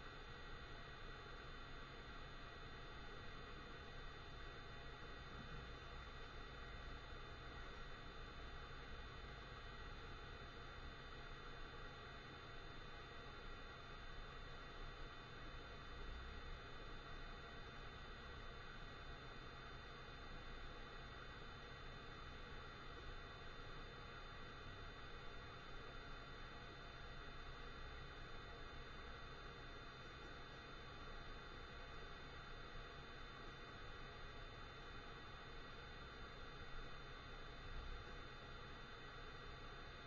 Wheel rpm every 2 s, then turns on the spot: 0, 0, 0, 0, 0, 0, 0, 0, 0, 0, 0, 0, 0, 0, 0, 0, 0, 0, 0, 0.
none